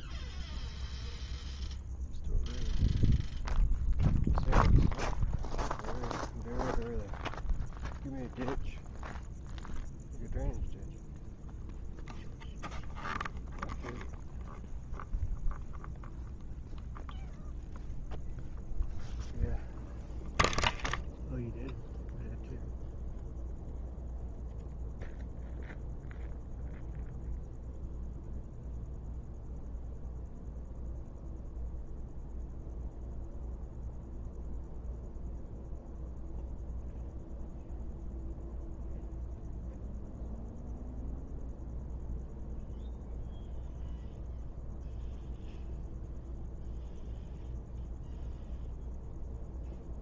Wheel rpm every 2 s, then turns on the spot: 0, 0, 0, 0, 0, 0, 0, 0, 0, 0, 0, 0, 0, 0, 0, 0, 0, 0, 0, 0, 0, 0, 0, 0, 0.
none